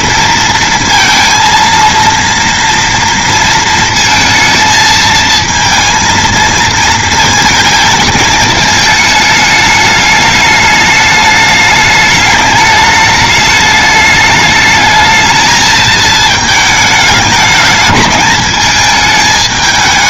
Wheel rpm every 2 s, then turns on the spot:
230, 230, 230, 230, 220, 210, 210, 210, 220, 210.
none